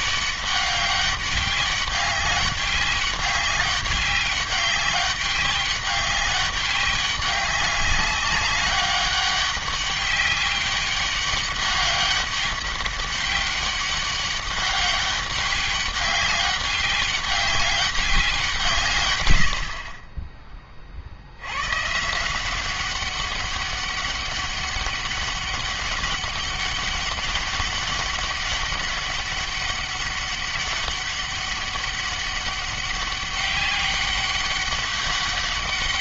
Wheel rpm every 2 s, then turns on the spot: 200, 200, 200, 200, 200, 200, 200, 200, 200, 130, 40, 190, 200, 200, 200, 200, 200, 200.
none